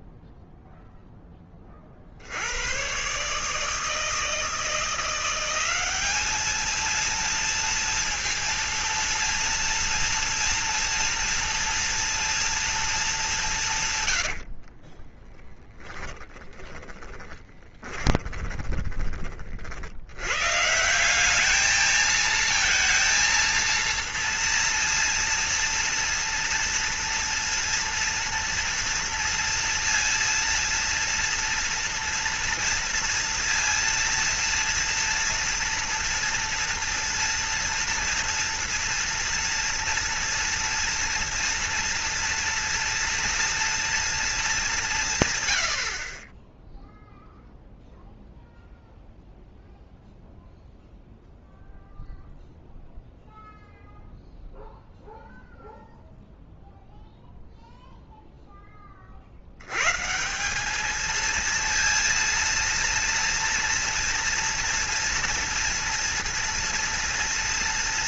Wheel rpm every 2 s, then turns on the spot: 0, 80, 160, 210, 230, 230, 230, 90, 10, 30, 160, 230, 230, 230, 230, 230, 230, 230, 230, 230, 230, 240, 80, 0, 0, 0, 0, 0, 0, 70, 220, 230, 230, 230.
14-20